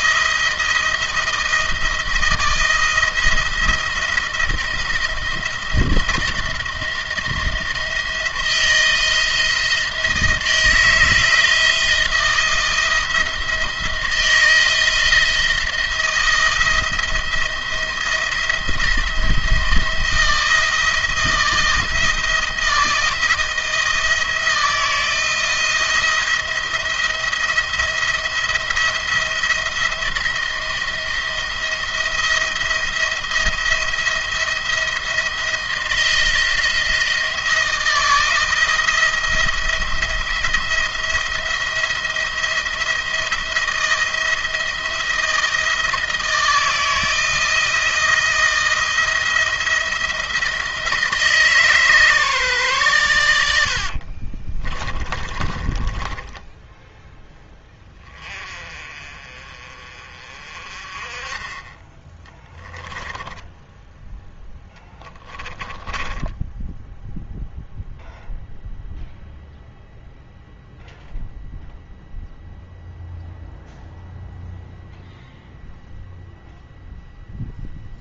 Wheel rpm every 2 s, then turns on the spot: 170, 170, 170, 170, 170, 160, 170, 170, 170, 170, 160, 170, 160, 170, 170, 170, 170, 170, 170, 170, 170, 170, 170, 160, 170, 160, 130, 30, 10, 30, 30, 10, 10, 10, 0, 0, 0, 0, 0.
54-58 62-64 66-68